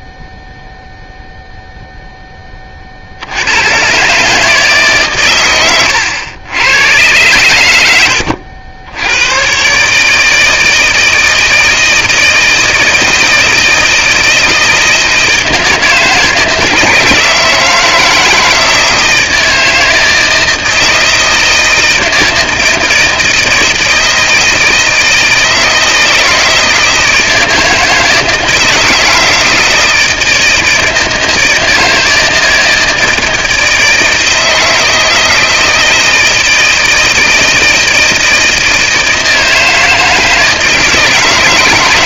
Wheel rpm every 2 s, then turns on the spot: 0, 70, 130, 110, 110, 160, 160, 160, 160, 160, 160, 160, 160, 160, 160, 160, 160, 160, 160, 160, 160.
none